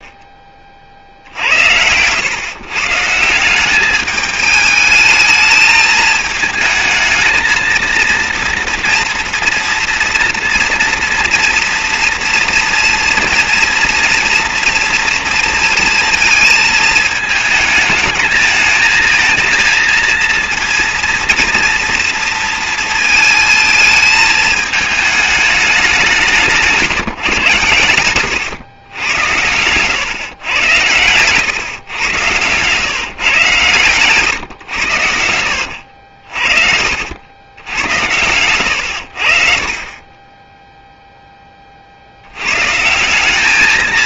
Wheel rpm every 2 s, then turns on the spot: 40, 130, 210, 220, 230, 230, 230, 230, 220, 220, 230, 230, 220, 160, 110, 110, 130, 120, 50, 100, 10, 120.
28-30 34-38